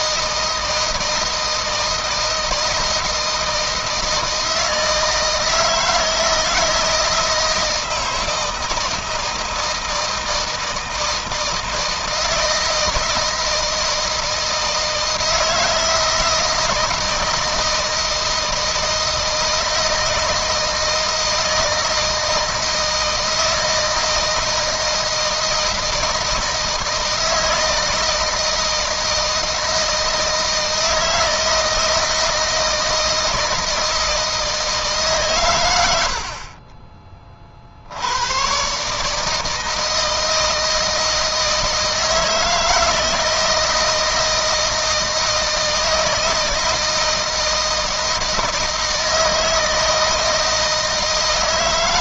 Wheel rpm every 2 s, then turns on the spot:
160, 160, 160, 160, 160, 160, 160, 160, 160, 160, 160, 160, 160, 160, 160, 160, 160, 160, 40, 120, 160, 160, 160, 160, 160, 160.
none